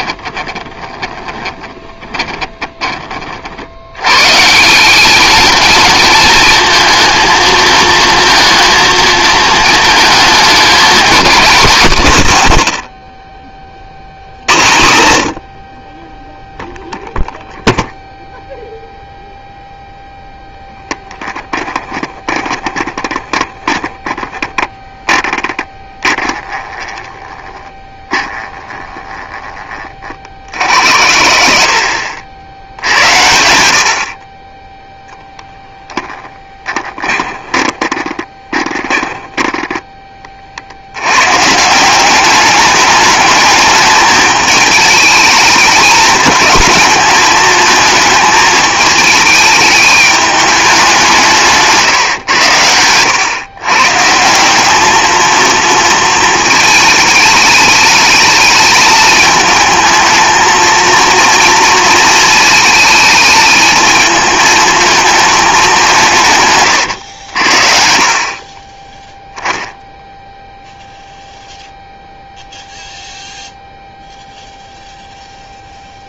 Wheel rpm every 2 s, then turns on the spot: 20, 40, 210, 230, 220, 220, 70, 60, 0, 0, 10, 20, 10, 20, 10, 70, 80, 0, 20, 20, 80, 210, 220, 220, 210, 190, 100, 210, 220, 220, 230, 220, 220, 110, 20, 0, 0, 0.
0-2 20-24 26-28 36-40